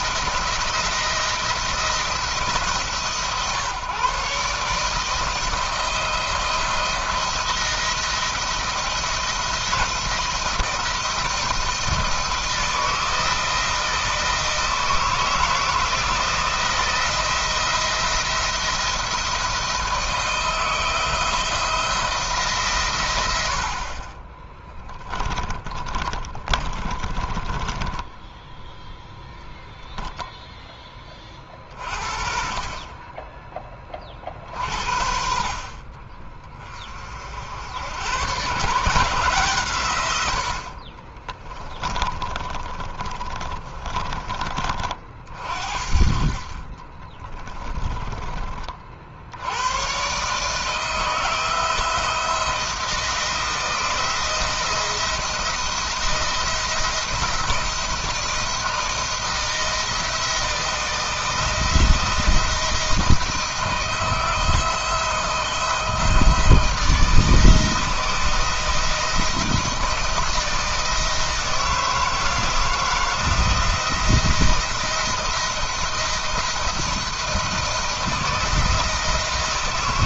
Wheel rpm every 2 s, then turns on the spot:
170, 150, 160, 170, 170, 170, 160, 160, 170, 170, 170, 130, 10, 20, 10, 30, 30, 50, 50, 150, 40, 30, 40, 30, 60, 160, 170, 170, 170, 170, 160, 170, 160, 160, 170, 160, 170, 170, 170, 170.
24-28 40-44 46-48